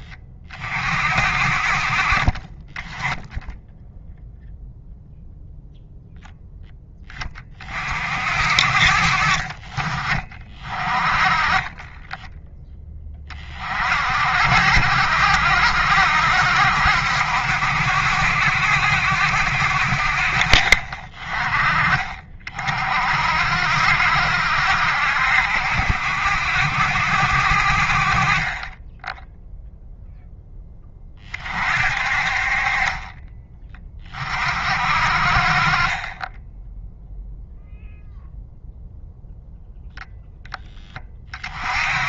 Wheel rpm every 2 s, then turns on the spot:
40, 20, 0, 10, 50, 30, 10, 60, 70, 70, 40, 50, 60, 70, 10, 10, 40, 50, 0, 0, 10.
20-22